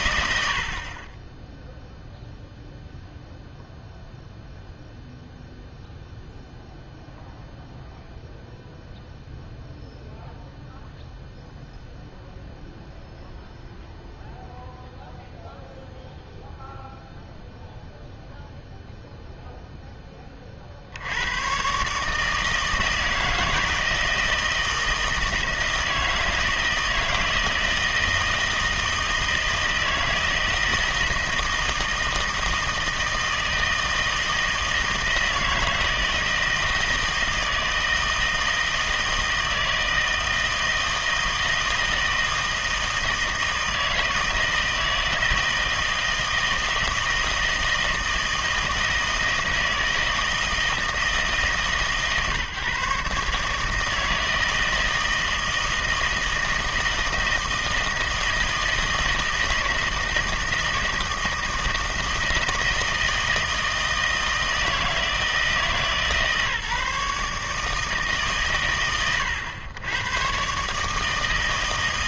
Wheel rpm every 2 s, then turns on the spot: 60, 0, 0, 0, 0, 0, 0, 0, 0, 0, 50, 160, 160, 160, 160, 160, 160, 160, 160, 160, 160, 160, 160, 160, 160, 160, 140, 160, 160, 160, 160, 160, 160, 150, 100, 140.
none